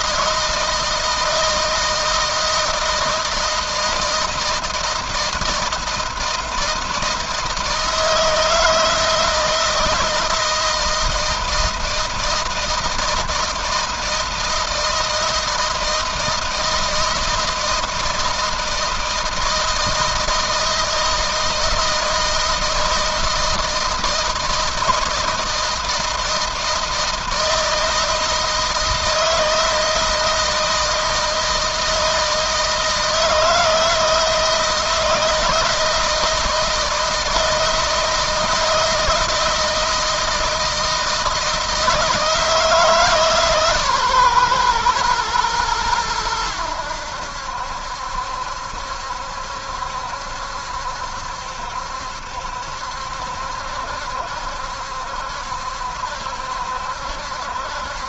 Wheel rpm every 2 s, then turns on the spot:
160, 160, 160, 160, 160, 160, 160, 160, 160, 160, 160, 160, 160, 160, 160, 160, 160, 160, 160, 160, 160, 150, 120, 90, 70, 70, 70, 70, 70.
none